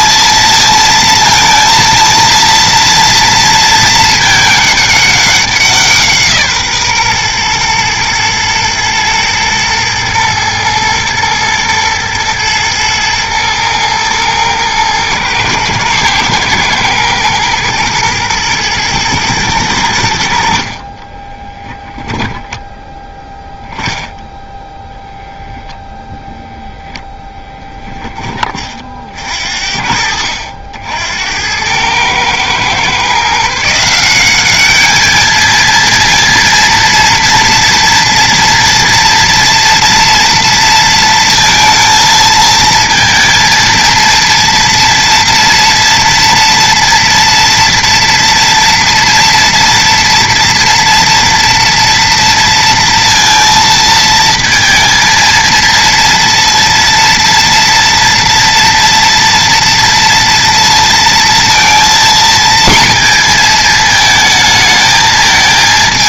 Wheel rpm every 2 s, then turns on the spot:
230, 230, 210, 150, 110, 110, 110, 110, 120, 120, 50, 10, 0, 0, 40, 70, 120, 210, 230, 230, 230, 220, 230, 230, 230, 230, 230, 230, 230, 230, 230, 230, 220.
22-24